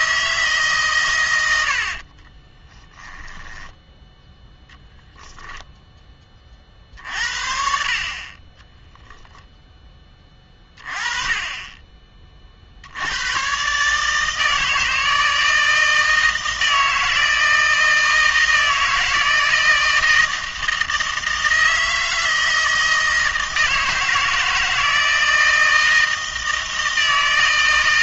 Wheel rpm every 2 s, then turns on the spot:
150, 20, 0, 40, 10, 20, 60, 160, 160, 160, 160, 160, 160, 160.
2-4 8-10